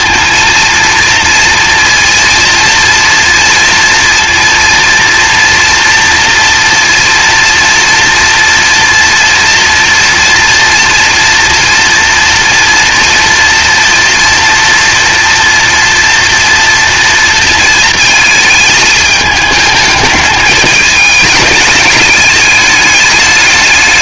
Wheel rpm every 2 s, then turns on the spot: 230, 230, 230, 230, 230, 230, 240, 230, 240, 220, 210, 210.
none